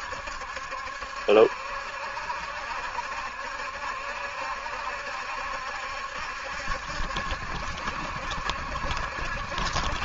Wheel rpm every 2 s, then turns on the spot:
70, 70, 70, 70, 70.
none